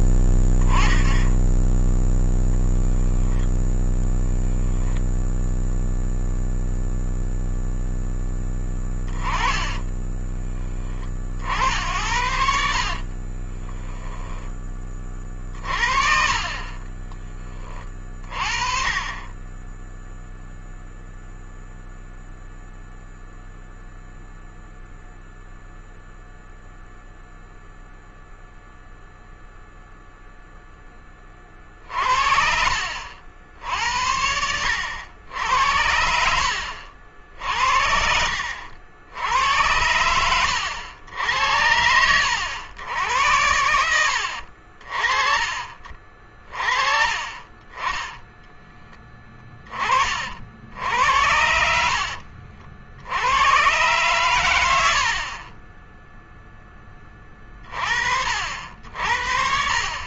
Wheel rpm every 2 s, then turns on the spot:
20, 10, 10, 0, 10, 10, 60, 10, 30, 30, 0, 0, 0, 0, 0, 0, 60, 70, 70, 60, 100, 80, 60, 40, 10, 50, 60, 100, 10, 60.
4-6 12-14 34-38